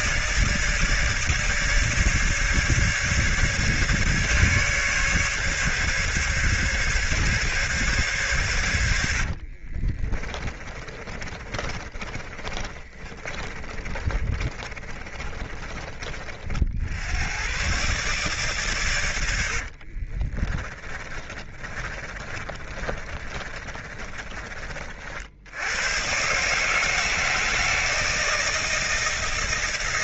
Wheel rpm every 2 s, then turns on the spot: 160, 150, 150, 140, 120, 30, 30, 40, 40, 130, 30, 30, 40, 140, 160.
10-16 20-24